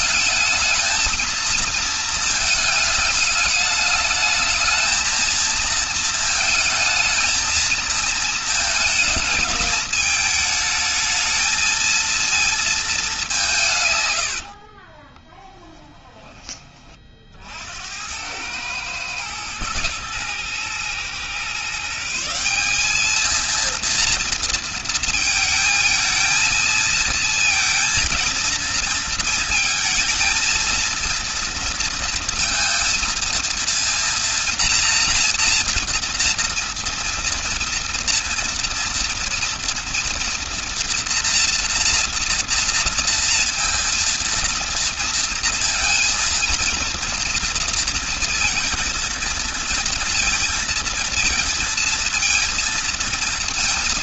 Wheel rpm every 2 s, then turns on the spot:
220, 220, 220, 220, 220, 220, 220, 40, 30, 110, 120, 200, 230, 220, 230, 230, 230, 240, 230, 230, 230, 230, 230, 230, 230, 230, 230.
14-16